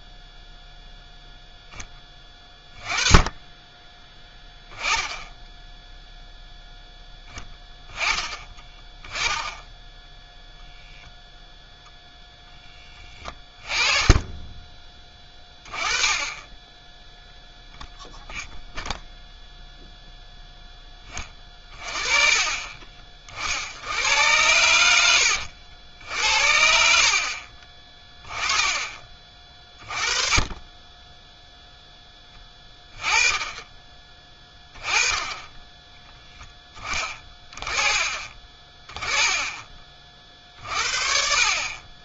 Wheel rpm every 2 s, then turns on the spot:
0, 20, 10, 10, 10, 0, 10, 10, 10, 0, 10, 20, 90, 80, 30, 20, 20, 10, 10, 20, 50.
8-10 12-14